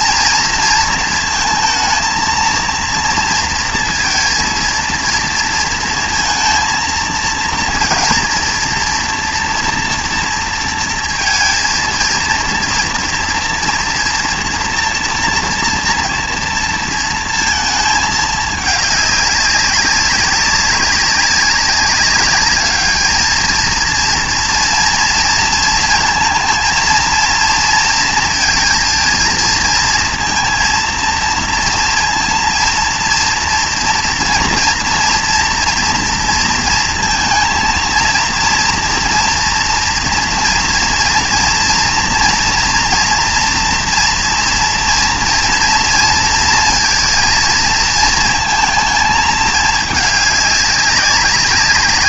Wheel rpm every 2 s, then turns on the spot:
230, 230, 230, 230, 230, 230, 230, 230, 230, 210, 200, 210, 230, 230, 230, 230, 230, 230, 230, 230, 240, 230, 230, 230, 230, 200.
none